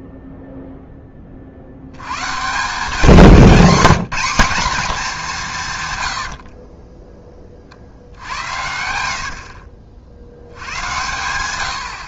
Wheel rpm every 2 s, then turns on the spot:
0, 170, 220, 30, 60, 90.
6-10